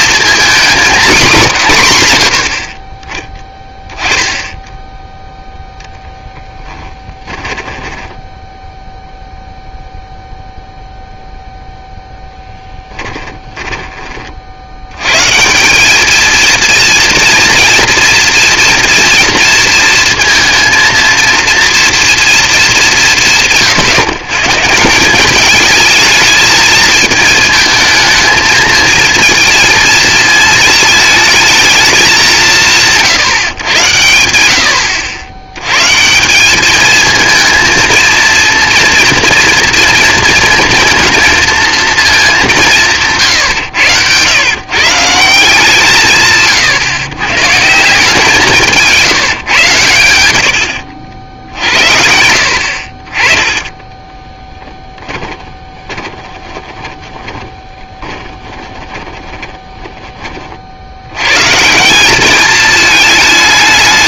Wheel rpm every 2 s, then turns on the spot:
240, 70, 10, 10, 10, 0, 10, 60, 230, 230, 230, 220, 150, 220, 220, 220, 180, 90, 200, 230, 230, 190, 130, 130, 170, 80, 70, 10, 20, 20, 40, 210.
6-10 50-52 54-60